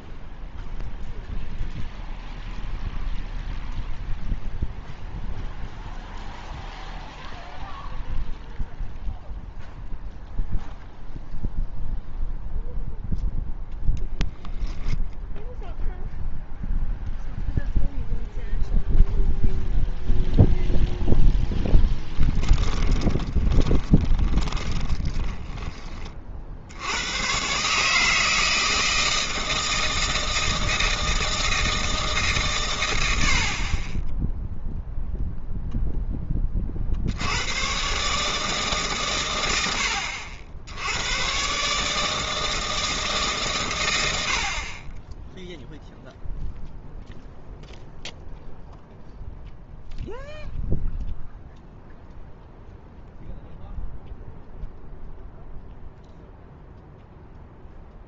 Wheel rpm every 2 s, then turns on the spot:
0, 0, 0, 0, 0, 0, 0, 0, 0, 0, 0, 10, 20, 60, 160, 160, 130, 0, 20, 150, 70, 160, 50, 0, 0, 0, 0, 0, 0.
22-26